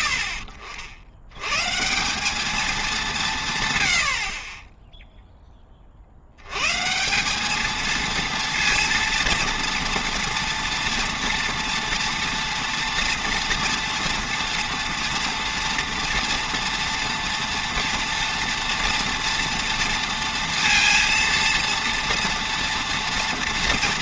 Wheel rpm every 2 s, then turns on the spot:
70, 220, 30, 130, 230, 230, 230, 230, 230, 230, 230, 230.
none